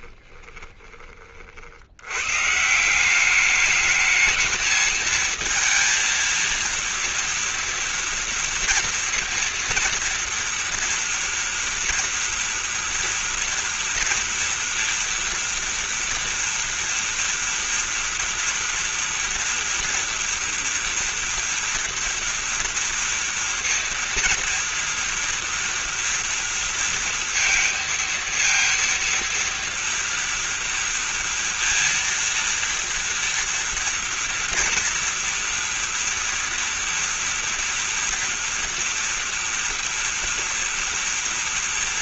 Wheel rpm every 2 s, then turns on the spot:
10, 160, 220, 230, 230, 240, 230, 230, 230, 240, 230, 230, 230, 230, 230, 230, 230, 240, 230, 230, 230.
none